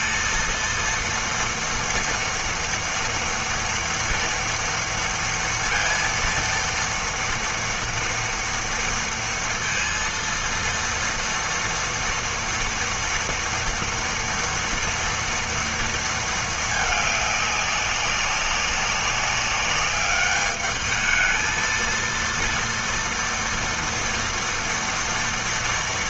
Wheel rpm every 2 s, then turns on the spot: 230, 230, 230, 230, 230, 230, 230, 230, 220, 190, 210, 230, 230.
none